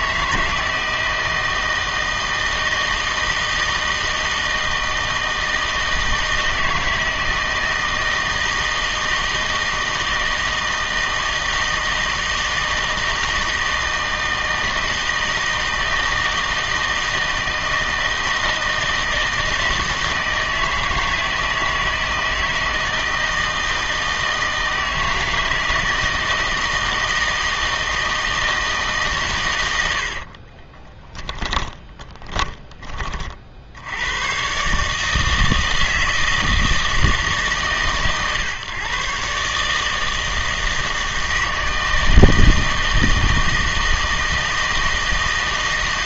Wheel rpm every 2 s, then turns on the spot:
160, 160, 160, 160, 160, 160, 160, 160, 160, 160, 160, 160, 160, 160, 150, 20, 20, 140, 160, 130, 160, 160, 160.
30-32